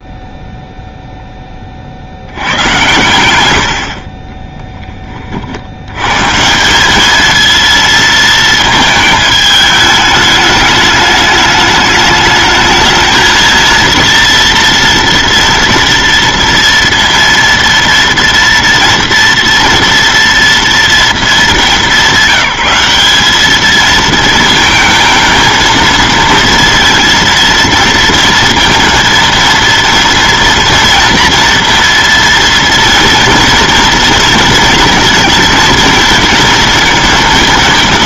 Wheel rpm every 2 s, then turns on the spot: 0, 100, 10, 200, 220, 210, 220, 230, 230, 230, 220, 200, 220, 230, 230, 230, 230, 230, 230.
none